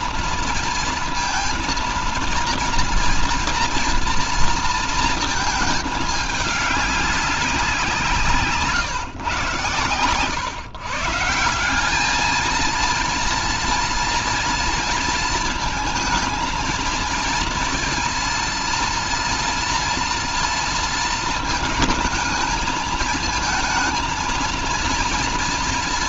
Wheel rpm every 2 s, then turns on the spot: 230, 230, 230, 200, 150, 140, 220, 230, 230, 230, 230, 220, 230.
none